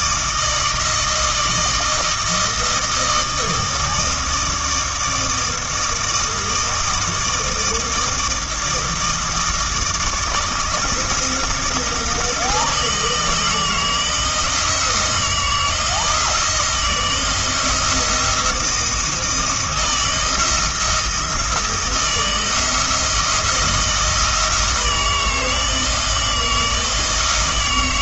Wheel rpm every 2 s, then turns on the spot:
160, 160, 160, 160, 160, 160, 160, 170, 170, 170, 170, 170, 160, 160.
none